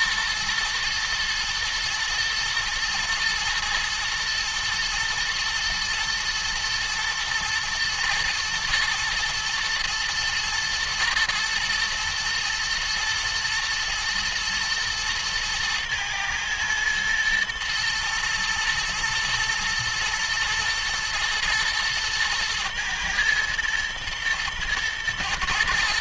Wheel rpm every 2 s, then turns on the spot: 120, 110, 120, 120, 110, 110, 110, 110, 110, 120, 110, 110, 110.
none